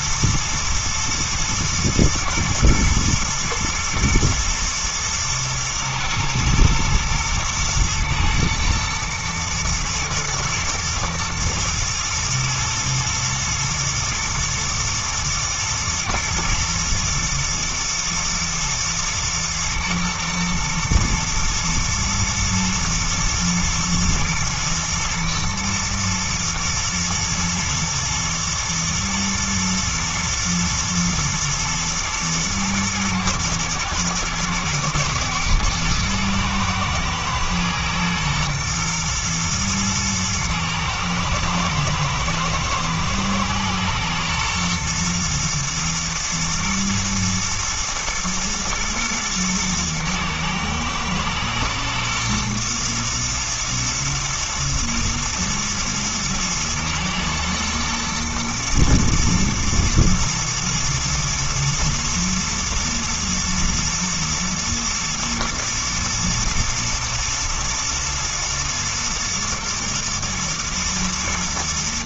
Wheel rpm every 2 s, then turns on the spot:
120, 120, 110, 110, 110, 110, 110, 110, 120, 120, 110, 120, 120, 120, 110, 120, 110, 110, 110, 120, 110, 110, 120, 120, 110, 110, 120, 110, 110, 110, 110, 110, 110, 120, 110, 110.
none